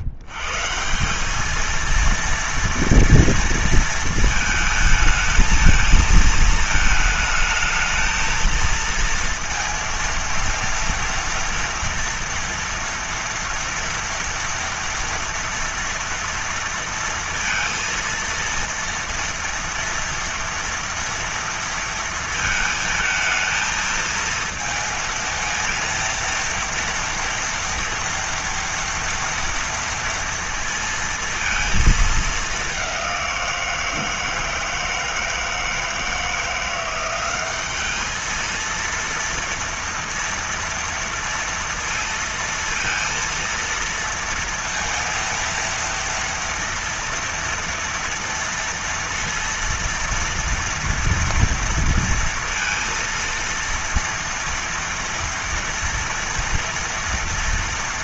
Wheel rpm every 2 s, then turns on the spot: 110, 230, 220, 220, 220, 230, 230, 230, 230, 230, 230, 230, 230, 230, 230, 230, 210, 160, 170, 220, 230, 230, 230, 230, 230, 230, 230, 230, 230.
none